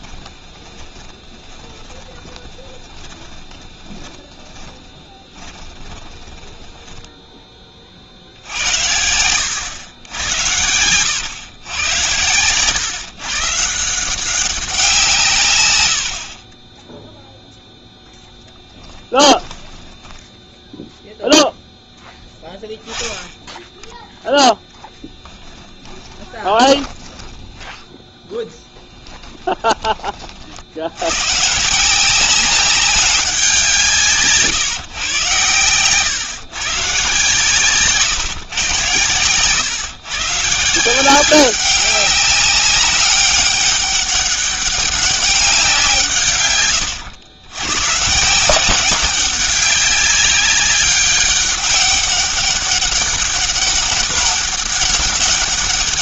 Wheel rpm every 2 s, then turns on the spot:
20, 20, 20, 10, 90, 90, 130, 180, 10, 10, 0, 10, 10, 10, 10, 80, 190, 140, 140, 120, 160, 200, 200, 110, 180, 200, 200, 200.
0-8 18-20 24-30